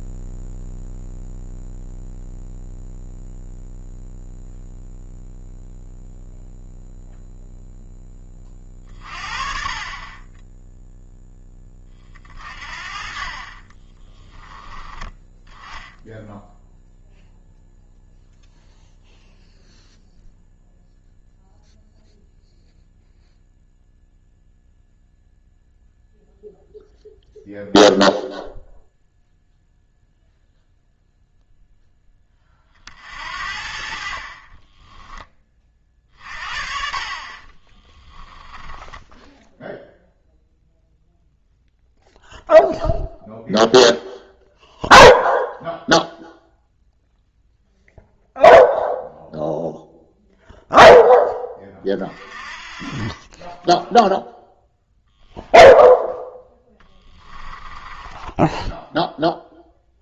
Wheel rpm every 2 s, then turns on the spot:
0, 0, 0, 0, 40, 0, 40, 10, 0, 0, 0, 0, 0, 0, 0, 0, 40, 20, 40, 10, 0, 0, 0, 0, 0, 0, 30, 0, 10, 0.
34-36 56-58